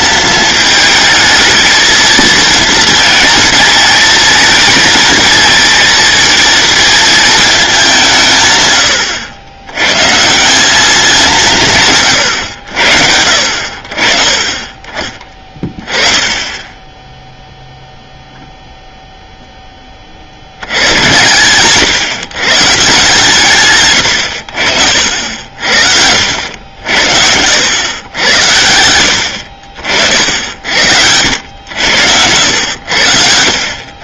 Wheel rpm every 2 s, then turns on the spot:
220, 220, 220, 230, 110, 190, 80, 20, 10, 0, 100, 140, 60, 70, 90, 80, 90.
none